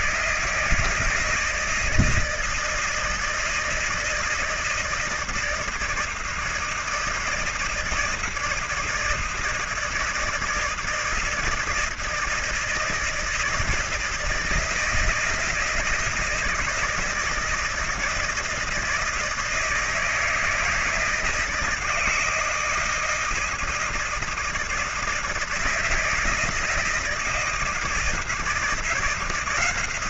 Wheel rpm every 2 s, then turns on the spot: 160, 160, 160, 160, 160, 160, 160, 160, 160, 170, 160, 160, 160, 160, 160.
none